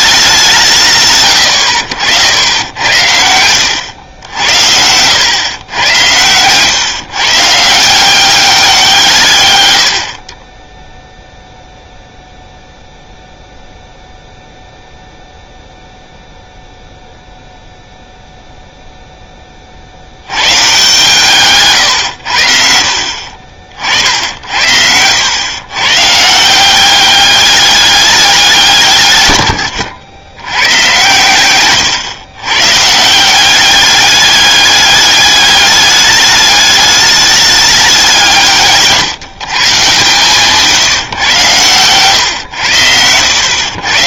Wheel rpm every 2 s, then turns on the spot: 170, 80, 90, 120, 180, 20, 0, 0, 0, 0, 120, 60, 70, 180, 170, 120, 130, 200, 210, 150, 150, 90.
4-6 24-26